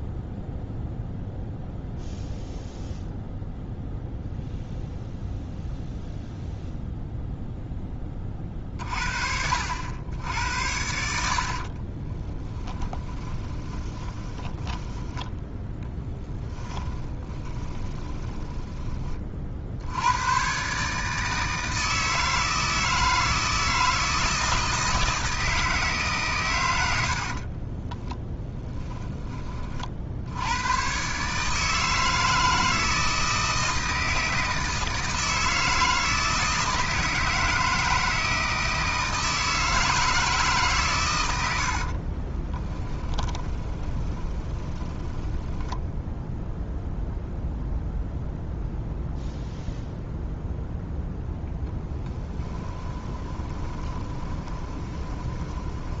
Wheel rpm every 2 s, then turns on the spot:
0, 0, 0, 0, 40, 70, 20, 10, 20, 20, 140, 160, 160, 90, 10, 120, 160, 160, 160, 160, 130, 30, 10, 0, 0, 0, 10, 20.
12-18 42-46 52-56